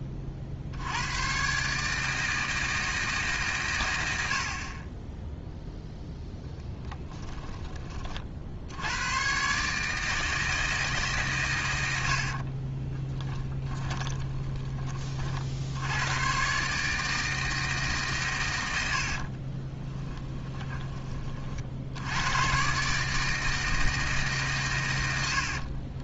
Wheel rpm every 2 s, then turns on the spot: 80, 160, 30, 10, 100, 160, 20, 30, 150, 80, 20, 140, 110.
12-14 18-20